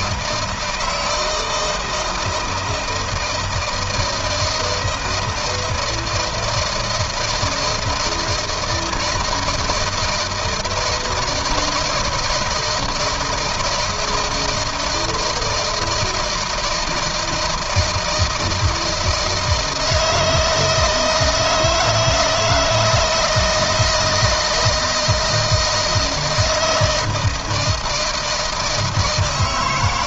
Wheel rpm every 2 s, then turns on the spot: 160, 160, 160, 160, 160, 160, 160, 160, 160, 160, 160, 170, 160, 160, 160.
none